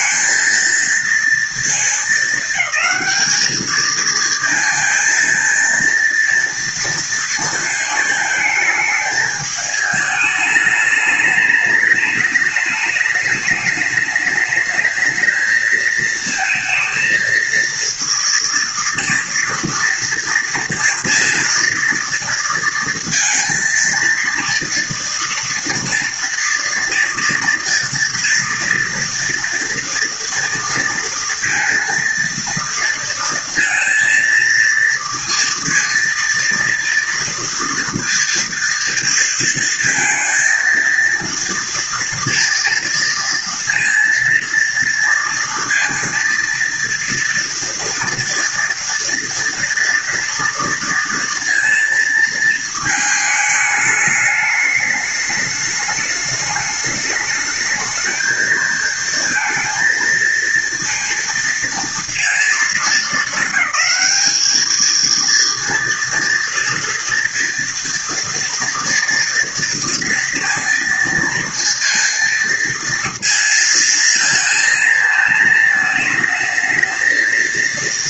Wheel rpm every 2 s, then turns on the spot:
230, 220, 220, 230, 220, 210, 210, 210, 220, 230, 230, 230, 230, 230, 230, 230, 230, 230, 230, 230, 230, 230, 230, 230, 230, 230, 220, 210, 210, 220, 230, 230, 220, 230, 230, 230, 230, 230, 220.
none